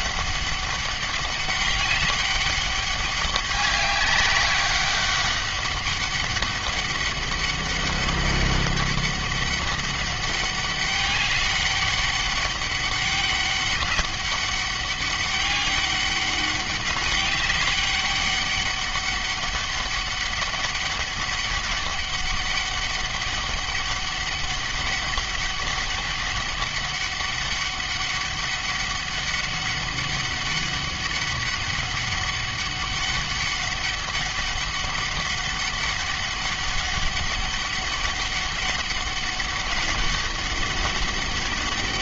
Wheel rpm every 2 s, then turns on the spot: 200, 200, 200, 200, 200, 200, 200, 200, 200, 200, 200, 200, 200, 200, 200, 200, 200, 200, 200, 200, 190.
none